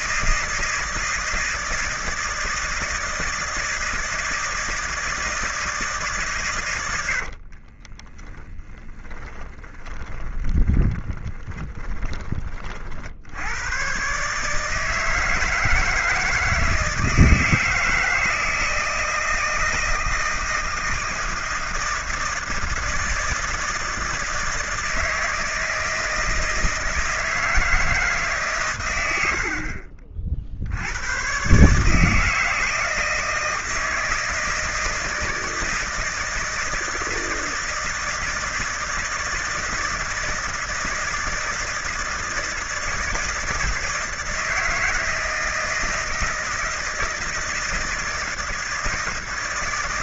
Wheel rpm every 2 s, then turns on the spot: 160, 160, 160, 120, 20, 20, 30, 150, 160, 160, 160, 160, 160, 160, 130, 60, 160, 160, 160, 160, 160, 160, 160, 160, 160.
8-12